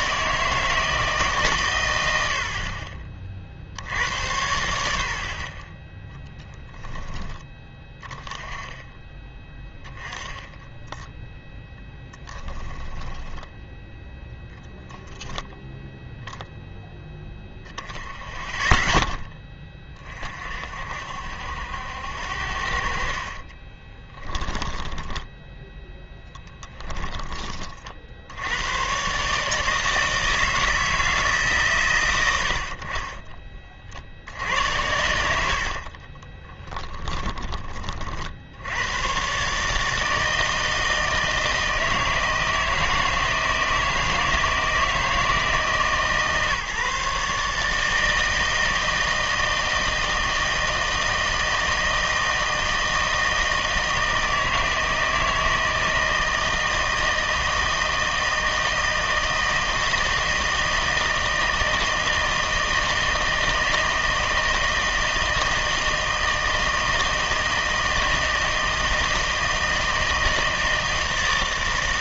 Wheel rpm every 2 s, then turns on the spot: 160, 40, 90, 10, 20, 10, 10, 10, 0, 10, 50, 60, 10, 10, 110, 160, 50, 100, 10, 100, 160, 160, 160, 150, 160, 160, 160, 160, 160, 160, 160, 160, 160, 160, 160, 160.
4-6 10-14 24-28 36-38